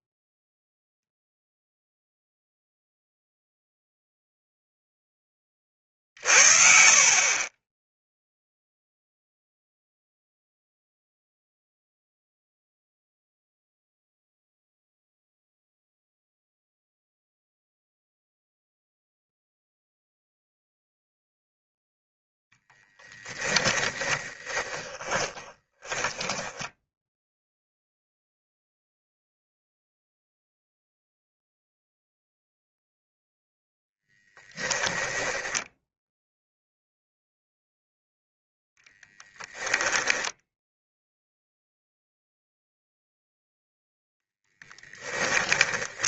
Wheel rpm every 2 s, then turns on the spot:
0, 0, 0, 50, 0, 0, 0, 0, 0, 0, 0, 10, 20, 10, 0, 0, 0, 20, 0, 10, 0, 0, 10.
22-28 34-36 38-40 44-46